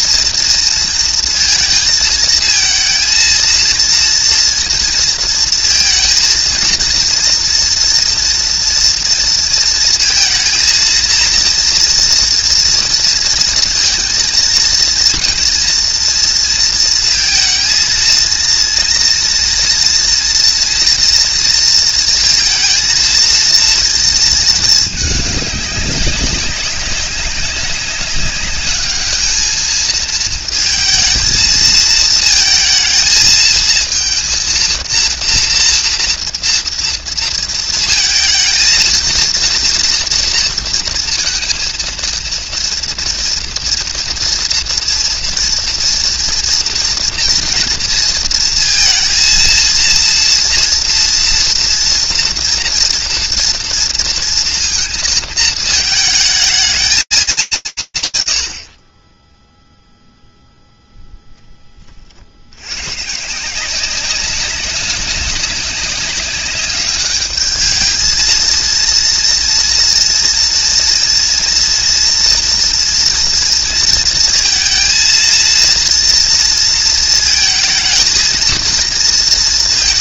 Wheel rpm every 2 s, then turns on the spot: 230, 230, 230, 230, 240, 230, 230, 230, 230, 230, 240, 230, 210, 190, 210, 220, 220, 230, 230, 230, 230, 230, 240, 230, 230, 230, 230, 230, 220, 80, 0, 110, 190, 200, 230, 230, 230, 230, 230, 230.
none